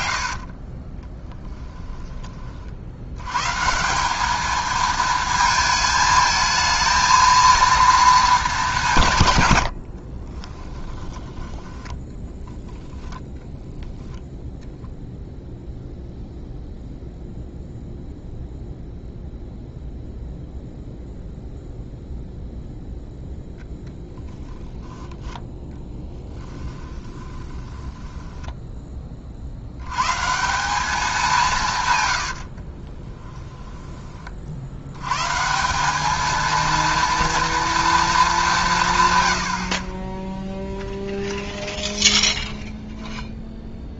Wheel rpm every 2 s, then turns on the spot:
30, 60, 220, 220, 170, 10, 10, 0, 0, 0, 0, 0, 10, 20, 20, 190, 30, 70, 230, 150, 10, 10.
0-2 10-12 26-28 32-34 40-42